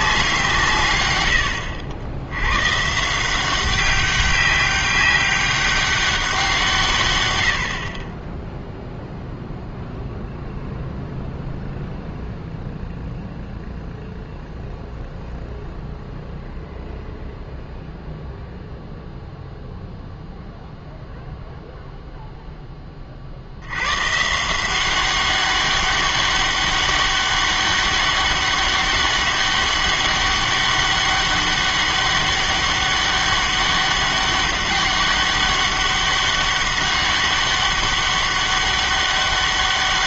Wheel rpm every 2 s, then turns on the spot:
160, 120, 190, 160, 0, 0, 0, 0, 0, 0, 0, 10, 160, 200, 200, 200, 200, 200, 200, 200.
none